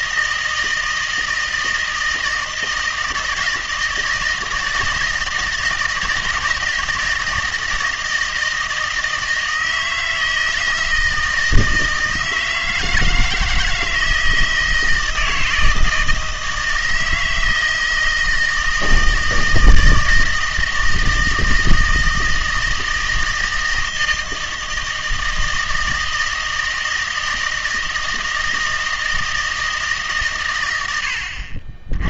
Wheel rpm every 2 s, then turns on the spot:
160, 160, 160, 160, 160, 160, 160, 160, 160, 160, 160, 160, 160, 160, 160, 110.
none